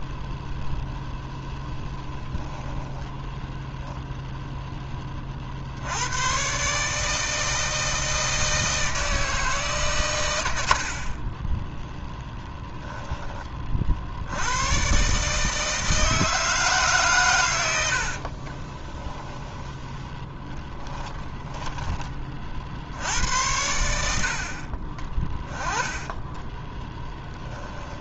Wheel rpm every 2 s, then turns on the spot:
0, 10, 10, 140, 160, 60, 10, 120, 150, 20, 10, 60, 40, 10.
10-14 18-22 24-28